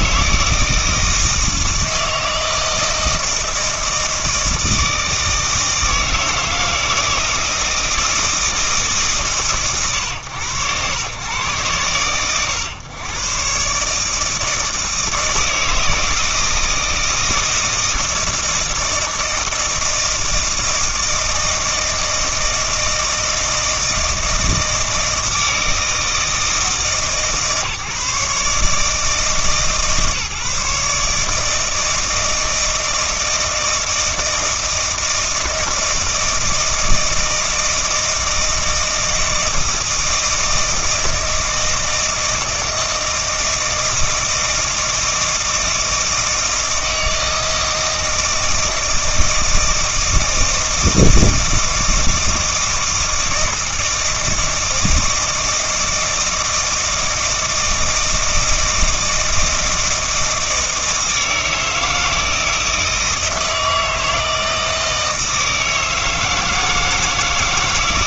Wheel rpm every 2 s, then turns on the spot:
160, 160, 160, 160, 150, 110, 120, 160, 160, 160, 160, 160, 160, 150, 160, 150, 160, 160, 160, 160, 160, 160, 160, 160, 160, 160, 160, 160, 160, 160, 160, 160, 160, 160.
none